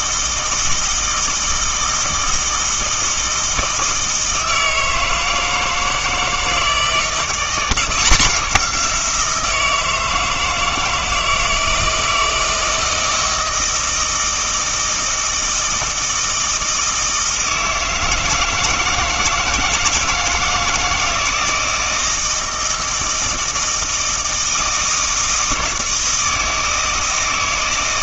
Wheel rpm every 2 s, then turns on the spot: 160, 160, 160, 160, 180, 160, 160, 160, 160, 160, 160, 160, 160, 160.
none